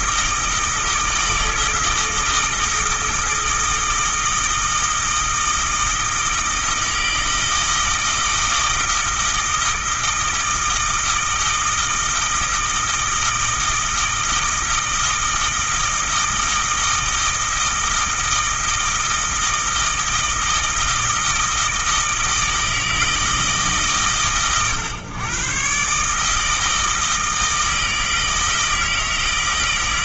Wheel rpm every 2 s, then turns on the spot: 160, 160, 160, 160, 160, 160, 160, 160, 160, 160, 160, 160, 120, 160, 160.
none